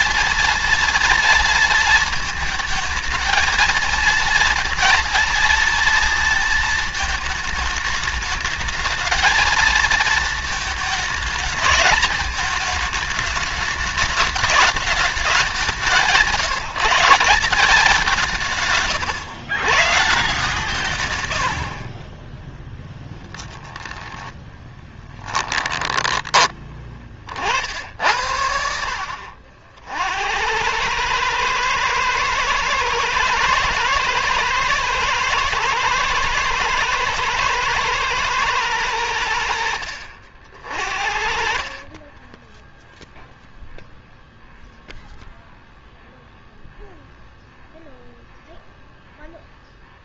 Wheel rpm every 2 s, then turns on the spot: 230, 220, 230, 220, 220, 220, 220, 210, 170, 160, 150, 10, 10, 20, 60, 90, 120, 110, 110, 110, 50, 10, 0, 0, 0.
22-26 42-44